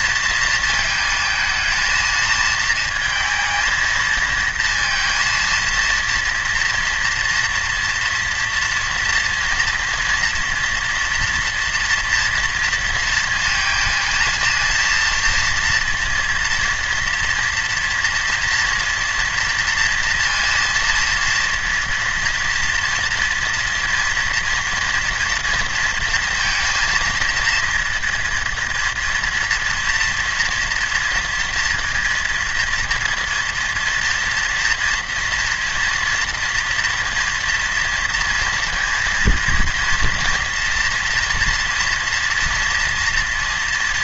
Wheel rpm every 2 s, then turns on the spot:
230, 220, 230, 240, 230, 240, 230, 230, 230, 240, 230, 230, 230, 230, 230, 240, 230, 230, 230, 230, 230, 230.
none